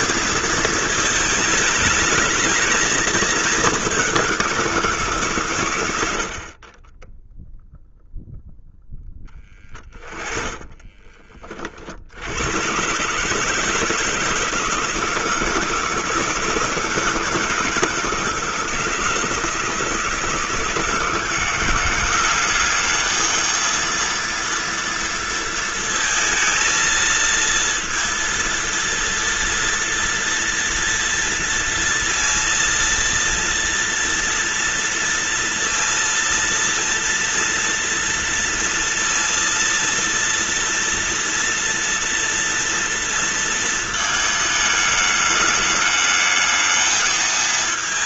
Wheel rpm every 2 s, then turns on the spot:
220, 220, 170, 30, 0, 30, 120, 160, 160, 160, 160, 200, 230, 230, 230, 230, 230, 230, 230, 230, 230, 230, 220, 220.
10-12